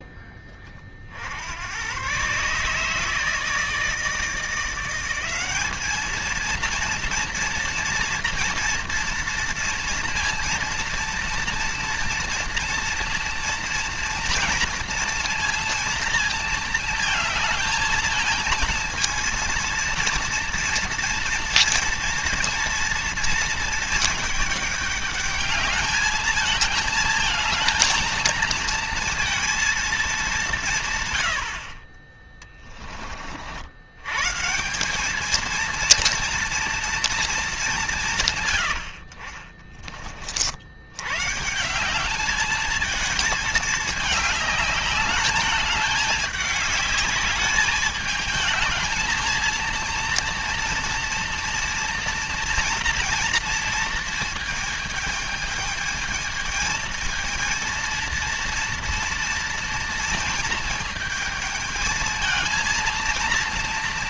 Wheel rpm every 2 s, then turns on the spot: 20, 140, 170, 230, 230, 230, 230, 230, 230, 230, 230, 230, 210, 220, 230, 170, 20, 170, 230, 100, 70, 210, 210, 210, 220, 230, 230, 220, 220, 230, 230, 230.
30-32